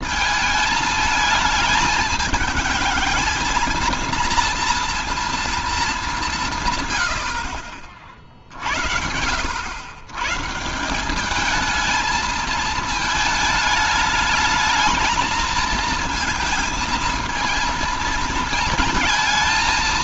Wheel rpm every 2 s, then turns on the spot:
220, 220, 230, 130, 70, 170, 220, 220, 220, 220.
none